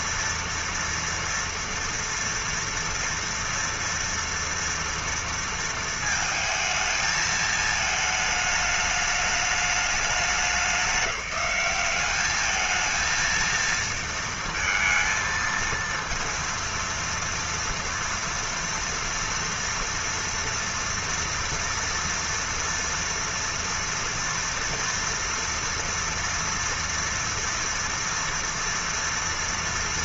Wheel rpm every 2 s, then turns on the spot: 230, 230, 230, 220, 210, 190, 210, 230, 230, 240, 230, 230, 230, 230, 240.
none